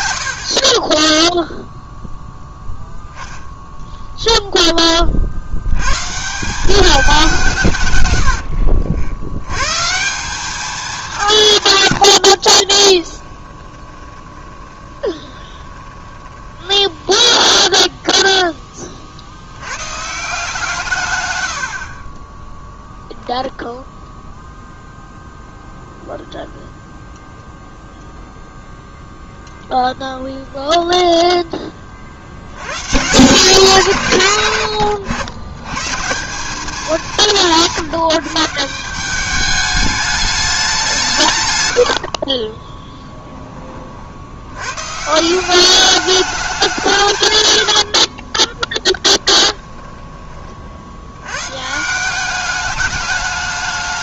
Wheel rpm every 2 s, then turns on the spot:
10, 10, 20, 190, 90, 200, 20, 20, 10, 30, 140, 0, 0, 0, 0, 0, 140, 100, 190, 180, 180, 20, 130, 180, 20, 70, 210.
12-18 42-44 48-50